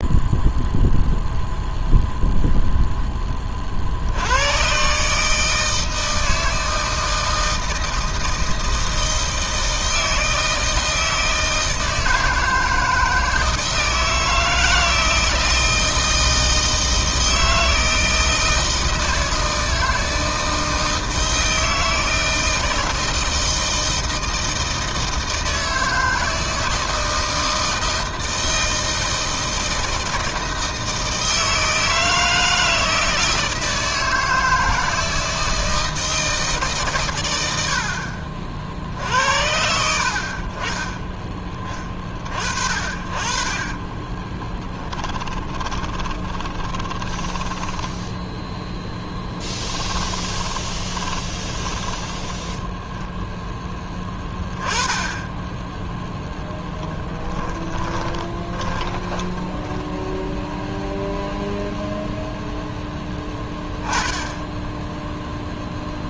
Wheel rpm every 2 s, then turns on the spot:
0, 10, 140, 160, 160, 160, 160, 160, 160, 160, 160, 160, 160, 160, 160, 160, 160, 160, 120, 60, 20, 40, 20, 10, 10, 20, 0, 10, 10, 10, 0, 10, 10.
44-48 50-52 56-60